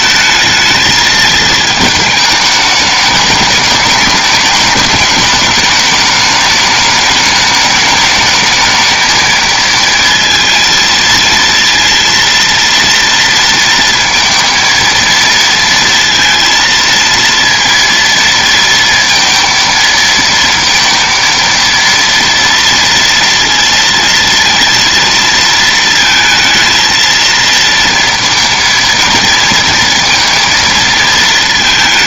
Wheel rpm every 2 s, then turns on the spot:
220, 210, 210, 210, 220, 230, 230, 230, 230, 230, 230, 230, 230, 230, 230, 230.
none